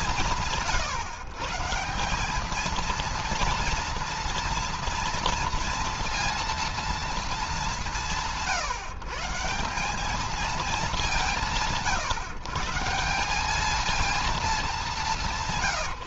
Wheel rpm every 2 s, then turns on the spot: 150, 230, 230, 180, 140, 140, 190, 180.
none